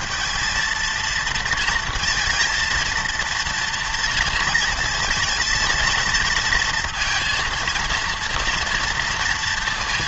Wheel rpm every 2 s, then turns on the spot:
220, 230, 230, 230, 230.
none